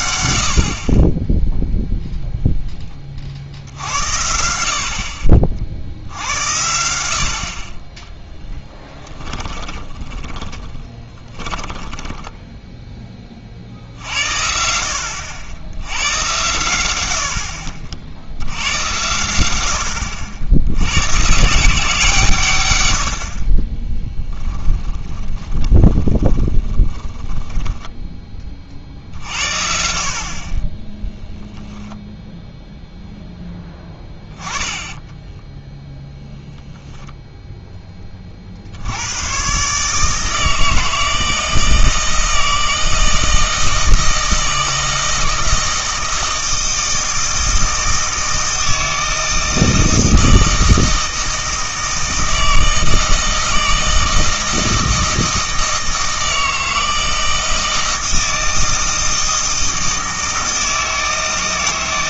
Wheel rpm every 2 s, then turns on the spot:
50, 10, 60, 80, 10, 20, 10, 70, 90, 90, 90, 100, 10, 20, 40, 20, 0, 10, 0, 70, 160, 160, 160, 160, 160, 160, 160, 160, 160, 160, 160.
8-12 24-28 34-36